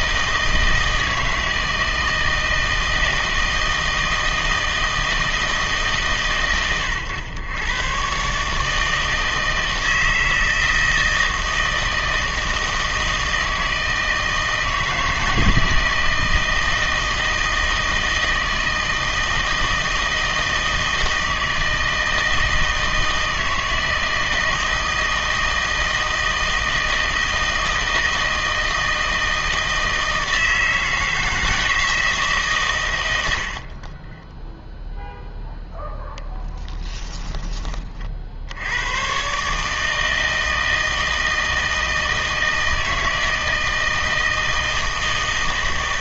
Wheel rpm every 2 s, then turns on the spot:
160, 160, 160, 120, 150, 160, 160, 160, 160, 160, 160, 160, 160, 160, 160, 160, 130, 0, 10, 80, 160, 160, 160.
36-38